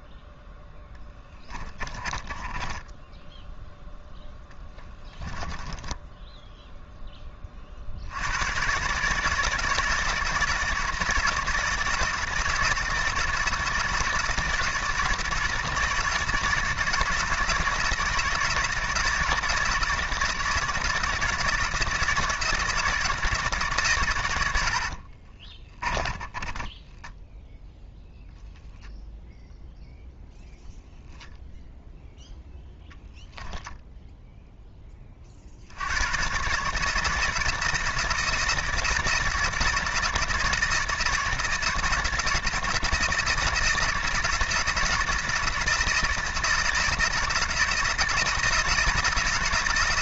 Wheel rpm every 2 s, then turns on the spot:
0, 20, 10, 0, 120, 160, 160, 170, 160, 160, 160, 160, 90, 20, 0, 0, 0, 10, 140, 160, 160, 160, 160, 160, 160.
2-6 24-28